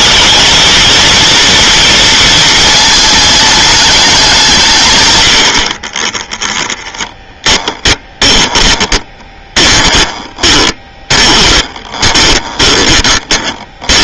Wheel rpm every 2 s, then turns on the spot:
220, 220, 170, 10, 20, 20, 20.
6-14